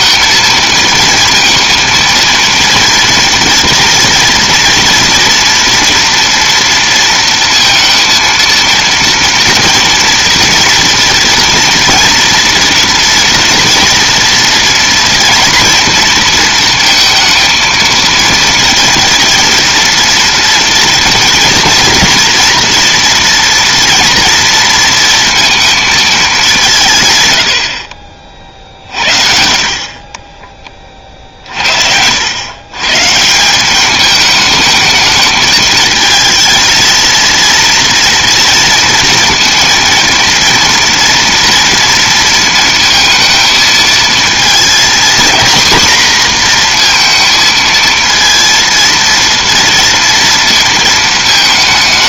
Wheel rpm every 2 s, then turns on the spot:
230, 230, 240, 230, 230, 240, 230, 240, 230, 230, 230, 230, 230, 180, 40, 30, 110, 210, 220, 230, 230, 230, 230, 240, 230, 230.
none